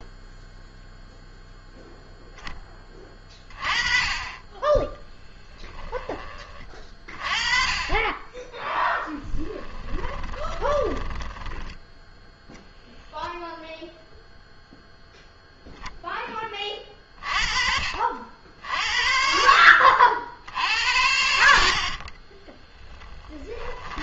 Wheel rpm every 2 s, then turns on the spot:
0, 20, 20, 30, 10, 20, 0, 0, 20, 60, 70, 20.
4-6 8-12 22-24